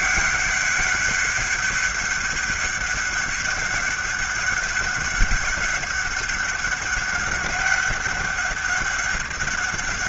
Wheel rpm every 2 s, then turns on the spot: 200, 200, 200, 200, 200.
none